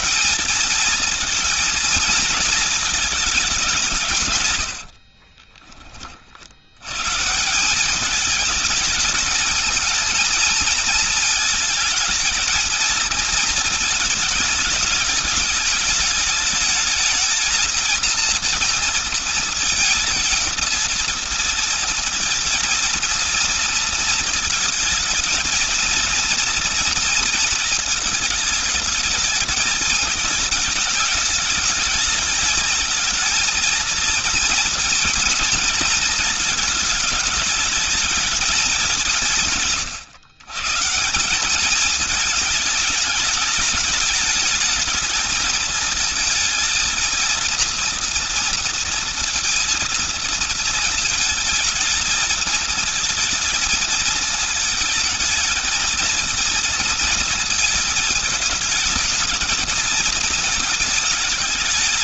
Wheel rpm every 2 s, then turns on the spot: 230, 230, 110, 100, 220, 230, 220, 210, 210, 230, 230, 230, 220, 230, 210, 220, 220, 230, 210, 210, 160, 210, 220, 220, 230, 220, 220, 220, 230, 220, 220.
4-6